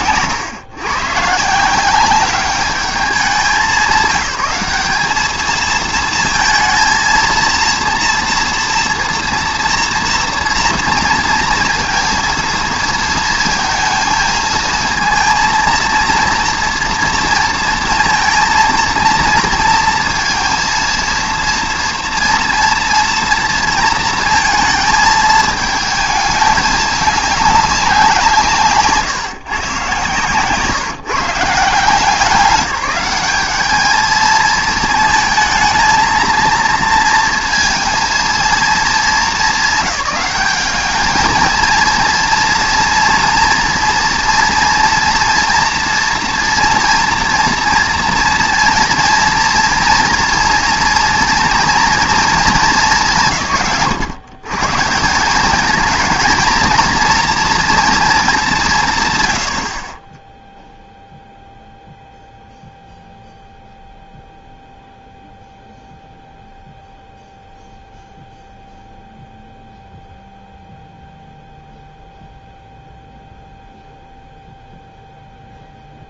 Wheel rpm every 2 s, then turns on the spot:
130, 200, 200, 230, 230, 230, 230, 230, 230, 230, 230, 230, 230, 210, 150, 150, 200, 220, 230, 210, 200, 230, 230, 230, 230, 230, 230, 130, 230, 200, 0, 0, 0, 0, 0, 0, 0, 0.
none